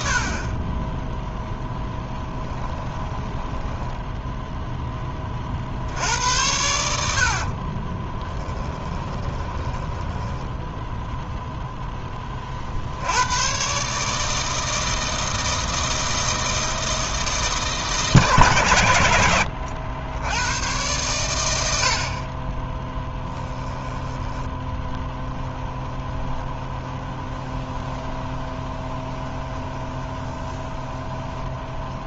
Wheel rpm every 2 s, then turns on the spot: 20, 20, 10, 80, 20, 10, 60, 160, 160, 100, 120, 10, 20, 20, 20, 20.
2-4 8-12 22-32